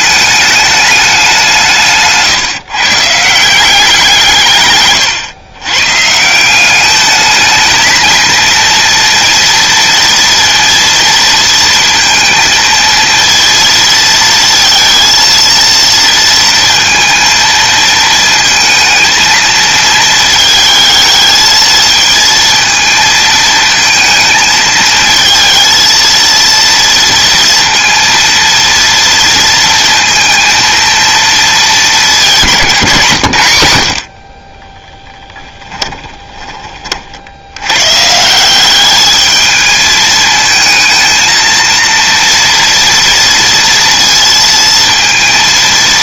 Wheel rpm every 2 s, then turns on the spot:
200, 160, 110, 210, 230, 230, 230, 230, 230, 220, 220, 220, 220, 230, 230, 230, 130, 10, 60, 210, 220, 230, 230.
34-36